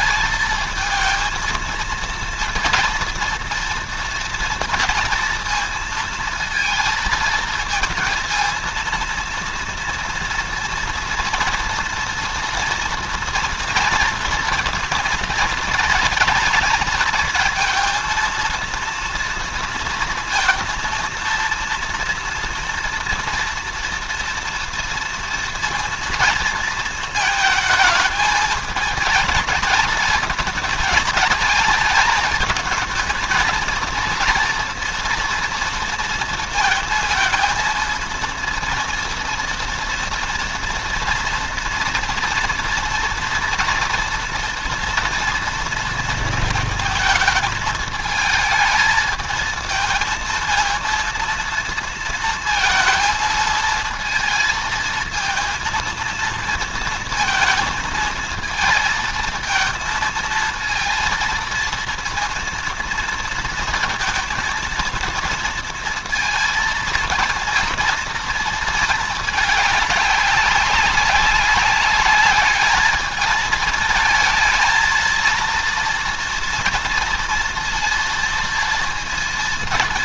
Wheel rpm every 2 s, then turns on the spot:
220, 230, 230, 230, 230, 230, 230, 230, 230, 230, 230, 230, 230, 220, 220, 220, 220, 230, 230, 230, 230, 230, 230, 220, 220, 230, 230, 230, 230, 220, 230, 230, 230, 230, 220, 190, 210, 230, 230, 230.
none